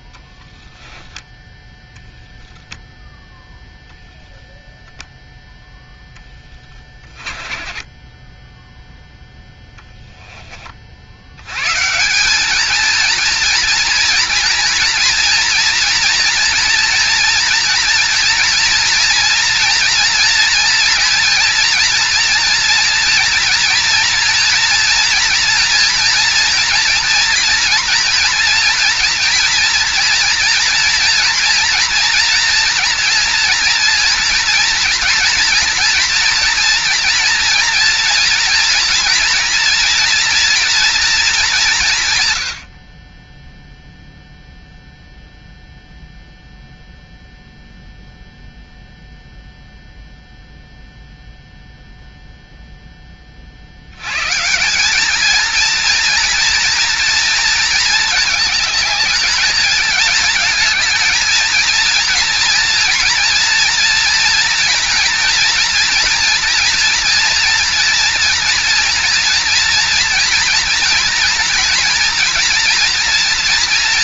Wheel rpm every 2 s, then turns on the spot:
10, 0, 0, 20, 10, 30, 220, 240, 230, 230, 230, 230, 230, 240, 240, 230, 230, 230, 230, 230, 240, 90, 0, 0, 0, 0, 0, 160, 230, 210, 220, 230, 230, 230, 240, 230, 230.
6-10